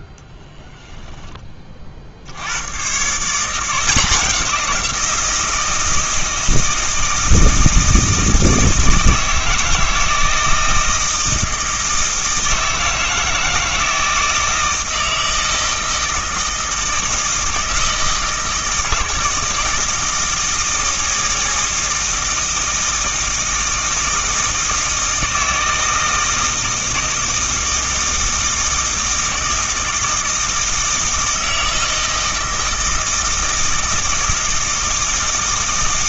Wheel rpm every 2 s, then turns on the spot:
10, 120, 180, 160, 160, 160, 160, 160, 160, 160, 160, 160, 160, 160, 160, 160, 160, 160.
none